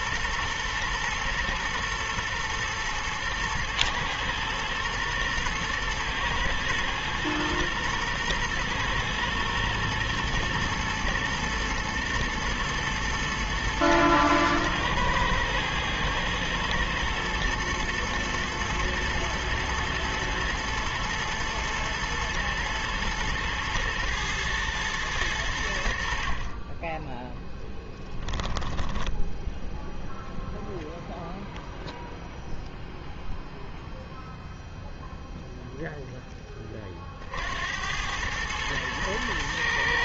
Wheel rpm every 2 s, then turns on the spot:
120, 120, 120, 110, 120, 120, 120, 110, 110, 120, 120, 120, 120, 30, 10, 0, 0, 0, 20, 110.
28-30